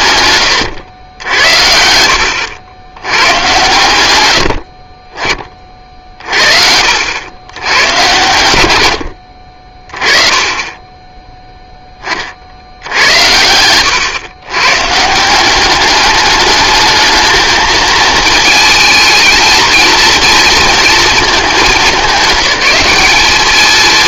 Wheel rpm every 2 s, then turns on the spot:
110, 90, 60, 50, 90, 20, 70, 130, 210, 220, 230, 210.
none